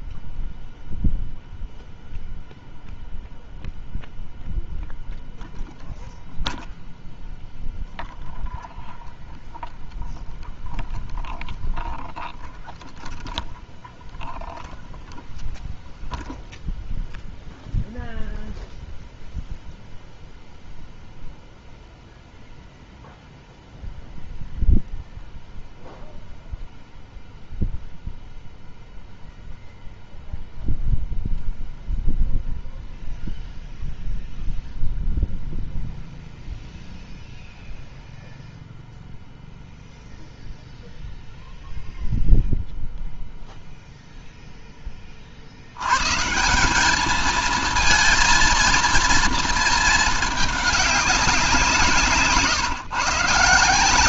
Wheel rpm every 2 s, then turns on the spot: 0, 0, 0, 0, 0, 0, 0, 0, 0, 0, 0, 0, 0, 0, 0, 0, 0, 0, 0, 0, 0, 0, 20, 190, 230, 200, 150.
none